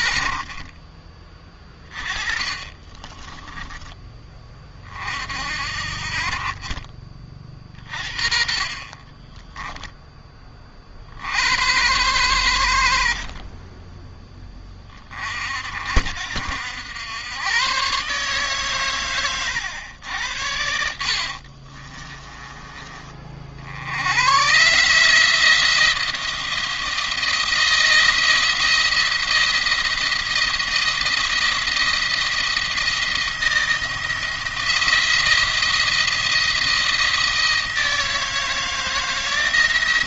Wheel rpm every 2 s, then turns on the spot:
40, 30, 40, 40, 30, 40, 80, 30, 90, 130, 60, 30, 140, 170, 170, 170, 170, 170, 170, 160.
0-4 8-10 20-22